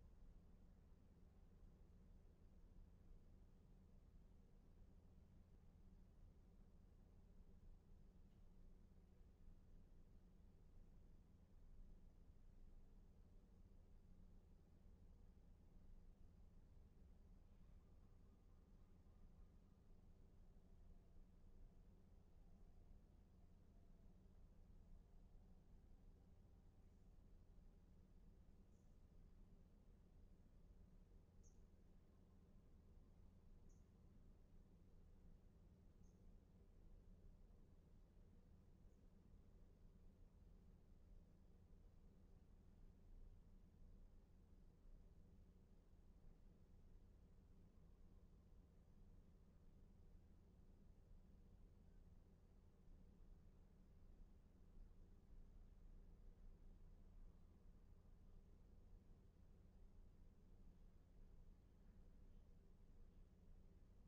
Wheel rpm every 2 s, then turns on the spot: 0, 0, 0, 0, 0, 0, 0, 0, 0, 0, 0, 0, 0, 0, 0, 0, 0, 0, 0, 0, 0, 0, 0, 0, 0, 0, 0, 0, 0, 0, 0, 0.
none